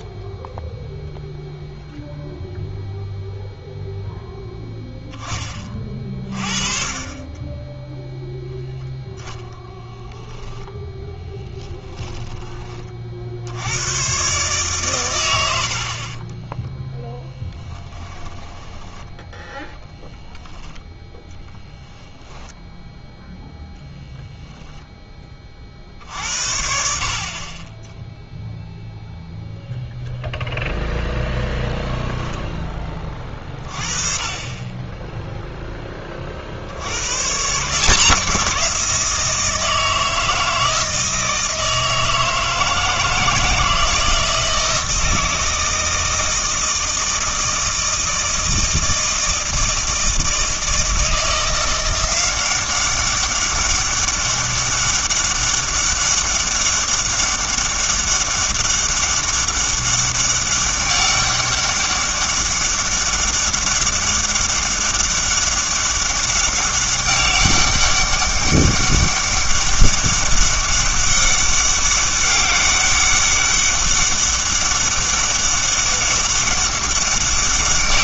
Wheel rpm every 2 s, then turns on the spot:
0, 0, 10, 30, 0, 0, 20, 130, 10, 10, 10, 0, 0, 60, 0, 0, 10, 20, 80, 170, 160, 160, 160, 160, 160, 160, 190, 190, 200, 200, 200, 200, 200, 200, 200, 200, 200, 200, 200.
16-20